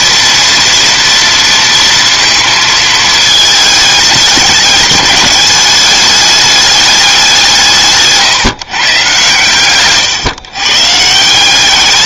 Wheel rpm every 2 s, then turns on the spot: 230, 220, 200, 200, 140, 150.
none